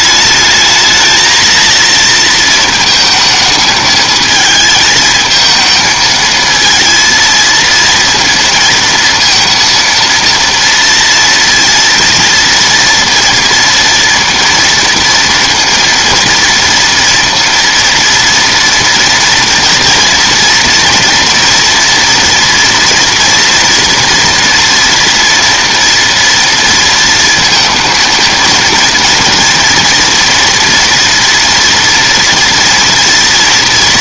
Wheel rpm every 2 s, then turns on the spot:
220, 230, 220, 230, 230, 230, 230, 230, 230, 230, 230, 230, 230, 230, 230, 230, 230.
none